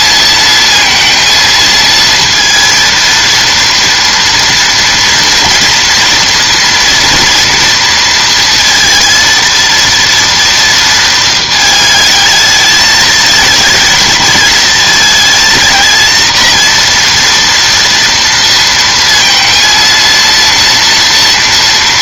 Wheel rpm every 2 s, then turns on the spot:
230, 230, 230, 230, 230, 230, 220, 220, 230, 230, 230.
none